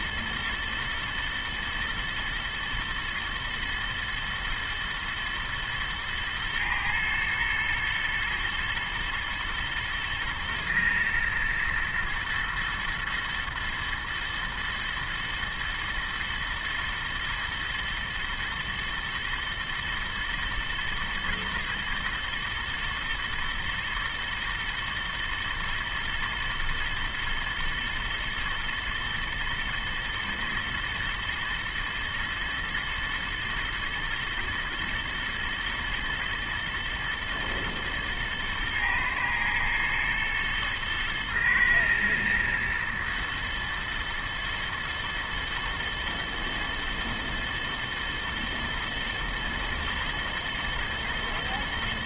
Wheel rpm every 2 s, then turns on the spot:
110, 110, 120, 110, 110, 120, 120, 110, 110, 120, 120, 120, 110, 110, 120, 110, 110, 110, 110, 110, 110, 110, 110, 110, 110, 110.
none